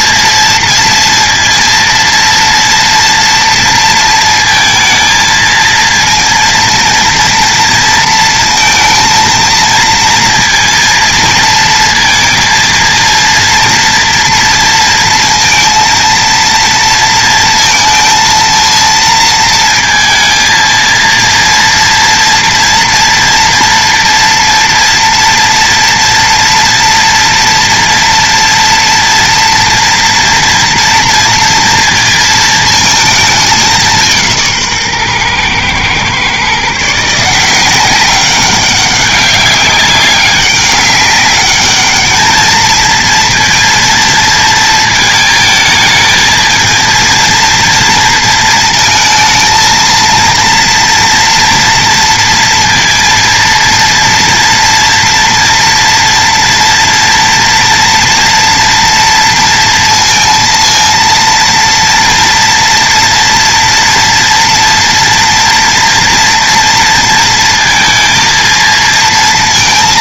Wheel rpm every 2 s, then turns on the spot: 230, 230, 220, 230, 230, 230, 230, 230, 230, 230, 230, 230, 230, 230, 230, 230, 220, 140, 160, 190, 200, 230, 220, 230, 220, 230, 230, 230, 230, 230, 230, 230, 230, 230, 230.
none